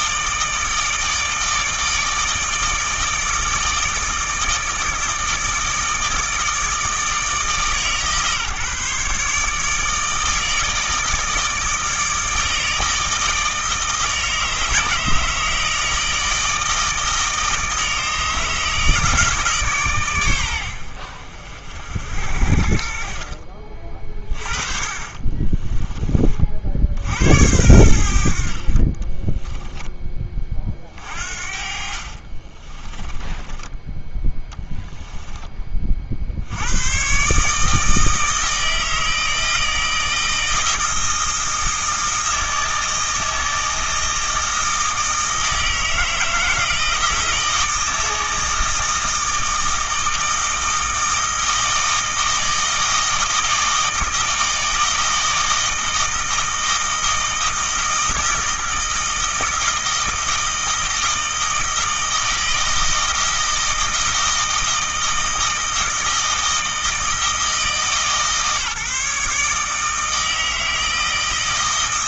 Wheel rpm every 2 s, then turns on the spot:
160, 160, 160, 160, 140, 160, 160, 160, 160, 150, 80, 50, 40, 70, 40, 40, 20, 10, 100, 160, 160, 160, 160, 160, 160, 160, 160, 160, 160, 160, 160, 160, 160, 160, 150, 160.
24-26 28-30 32-36